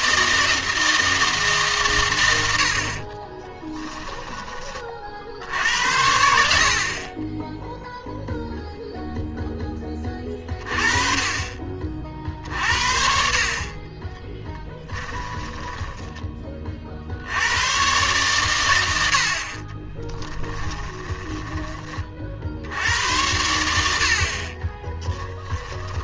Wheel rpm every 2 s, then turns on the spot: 160, 70, 30, 50, 0, 30, 60, 10, 50, 80, 20, 70, 30.
14-16 20-22 24-26